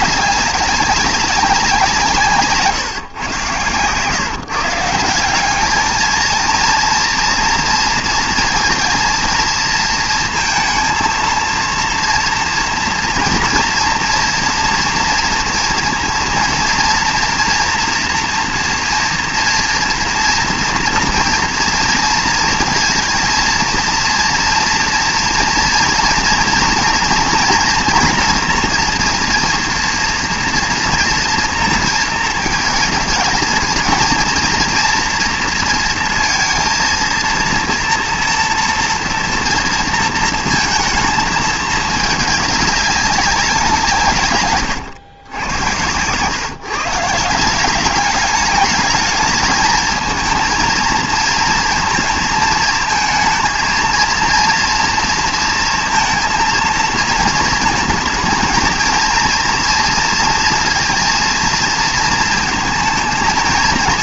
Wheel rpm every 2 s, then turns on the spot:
200, 140, 160, 230, 230, 230, 230, 230, 230, 230, 230, 230, 230, 230, 230, 240, 220, 230, 230, 240, 230, 200, 120, 140, 210, 230, 220, 230, 230, 230, 230, 230.
none